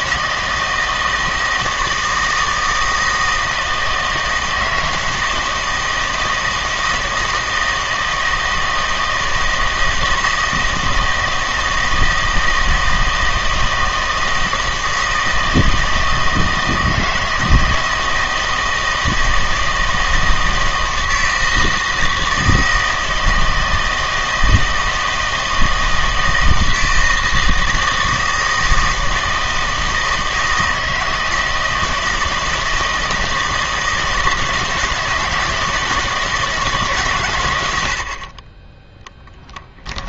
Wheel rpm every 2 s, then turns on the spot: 160, 160, 160, 160, 160, 160, 160, 160, 160, 160, 160, 160, 160, 160, 160, 160, 160, 160, 150, 20.
none